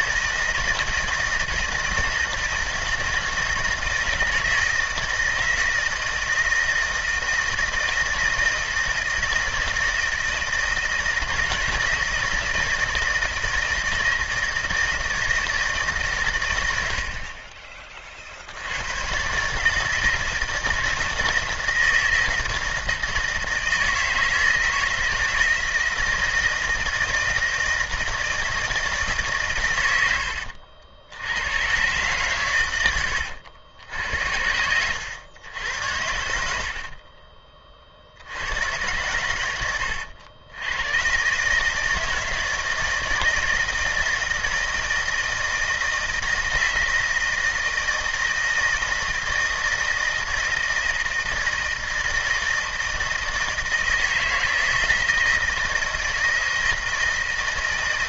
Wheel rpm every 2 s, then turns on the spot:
170, 160, 160, 160, 160, 160, 160, 160, 70, 100, 160, 160, 160, 160, 160, 80, 100, 90, 50, 90, 110, 160, 160, 160, 160, 160, 160, 160, 160.
32-34 36-38